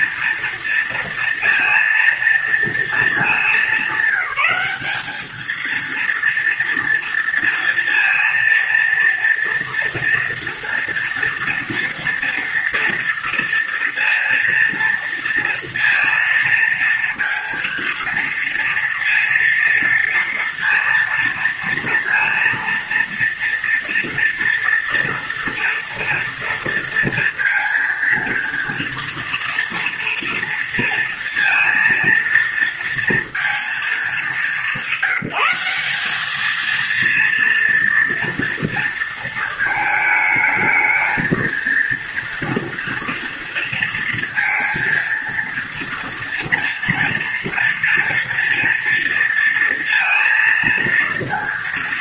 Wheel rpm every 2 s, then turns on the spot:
230, 230, 210, 230, 230, 230, 230, 230, 230, 230, 230, 240, 230, 230, 230, 230, 230, 200, 220, 230, 220, 230, 230, 230, 230, 230.
none